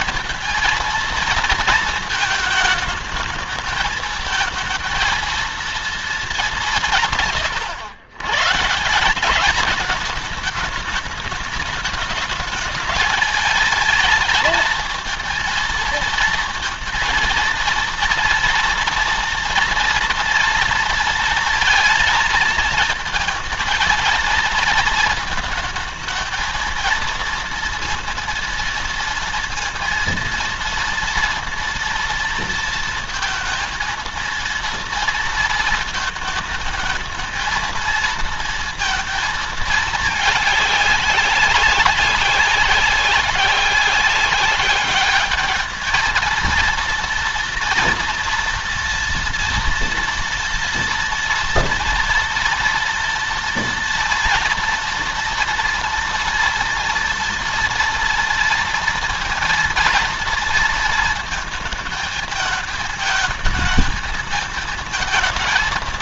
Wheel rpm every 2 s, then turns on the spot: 230, 220, 220, 190, 140, 210, 210, 230, 230, 230, 230, 220, 230, 220, 230, 230, 230, 230, 220, 230, 210, 190, 200, 220, 230, 240, 230, 240, 230, 230, 230, 220, 220.
none